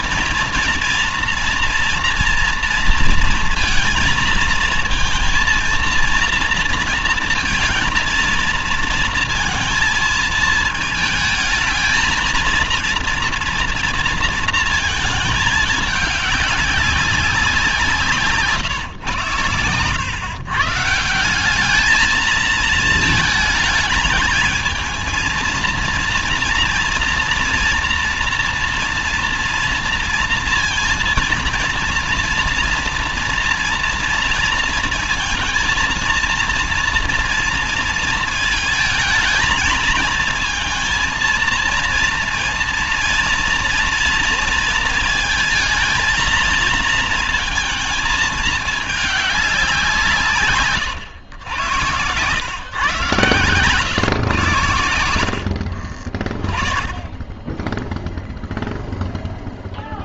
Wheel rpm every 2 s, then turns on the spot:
230, 230, 220, 230, 220, 220, 230, 220, 200, 140, 140, 220, 220, 230, 240, 230, 240, 230, 230, 220, 230, 230, 230, 230, 210, 130, 130, 110, 20, 0.
50-52